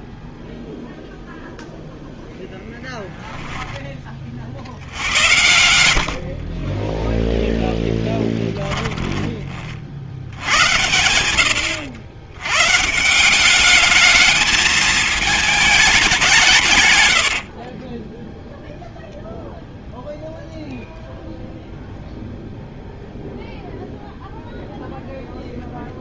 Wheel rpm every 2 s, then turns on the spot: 20, 0, 50, 40, 10, 80, 120, 220, 170, 10, 0, 0, 0.
6-10 18-20